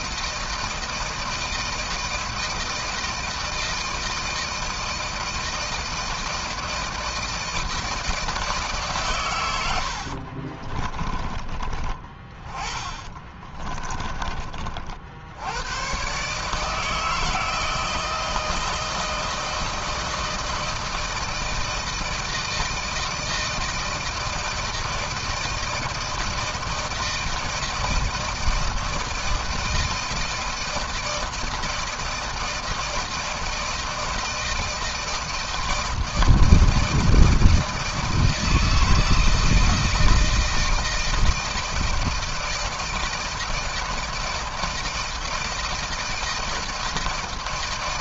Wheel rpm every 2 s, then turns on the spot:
160, 160, 160, 160, 130, 30, 20, 60, 160, 160, 160, 160, 160, 160, 160, 160, 160, 160, 160, 160, 160, 160, 160, 160.
12-14